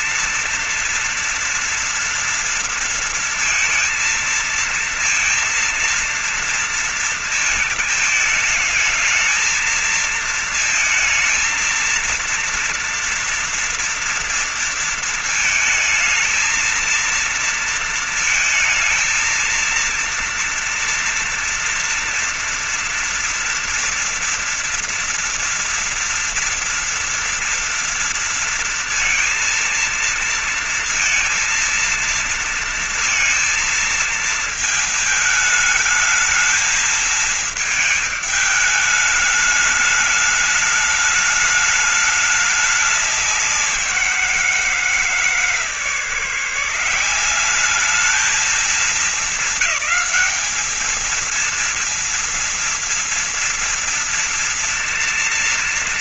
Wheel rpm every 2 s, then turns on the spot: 230, 230, 230, 230, 220, 230, 230, 230, 220, 220, 230, 230, 230, 230, 230, 230, 230, 230, 220, 220, 210, 210, 180, 150, 210, 210, 230, 230.
none